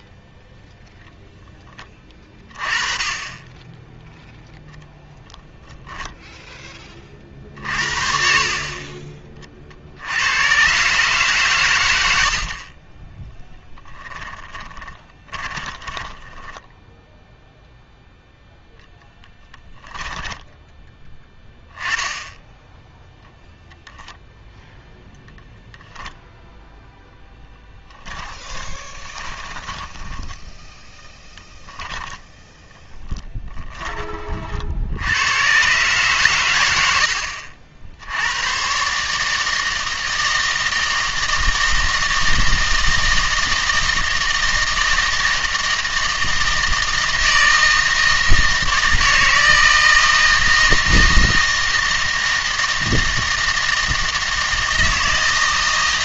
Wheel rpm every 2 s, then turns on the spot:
10, 20, 0, 20, 40, 130, 30, 20, 10, 0, 10, 0, 0, 0, 20, 10, 10, 60, 90, 130, 160, 160, 160, 160, 160, 160, 160, 160.
14-16 28-34